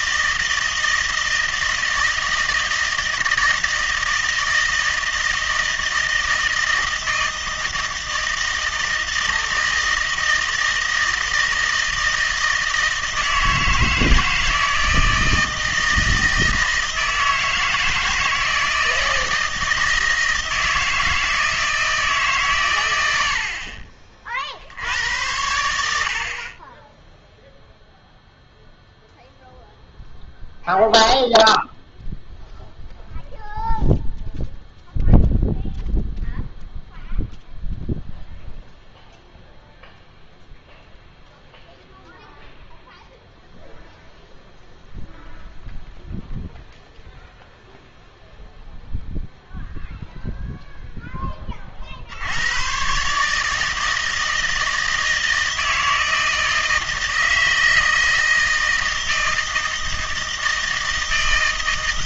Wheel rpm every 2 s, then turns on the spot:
160, 160, 160, 160, 160, 160, 160, 160, 160, 160, 160, 120, 70, 10, 0, 0, 0, 0, 0, 0, 0, 0, 0, 0, 0, 0, 110, 160, 160, 160, 160.
none